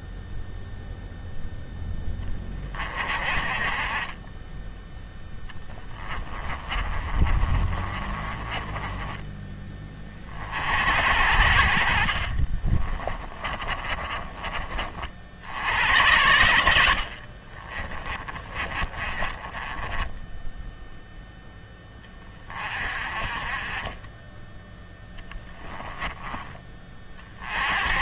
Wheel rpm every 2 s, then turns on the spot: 0, 30, 10, 30, 20, 70, 30, 40, 70, 30, 0, 40, 10, 30.
6-10 12-14 16-20 24-26